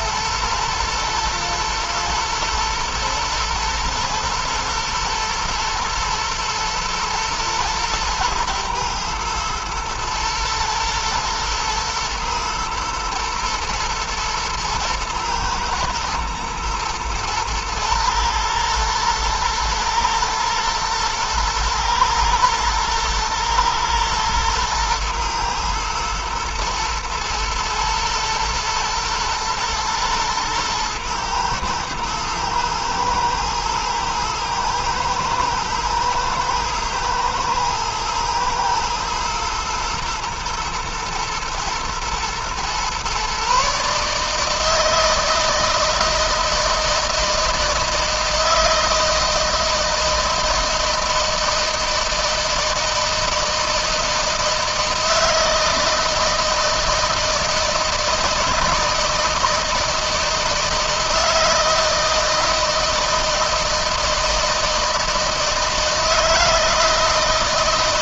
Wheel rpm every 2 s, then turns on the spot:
120, 120, 110, 120, 120, 120, 120, 120, 110, 120, 120, 110, 110, 110, 110, 110, 110, 110, 110, 110, 120, 120, 160, 160, 160, 160, 160, 160, 160, 160, 160, 160, 160, 160.
none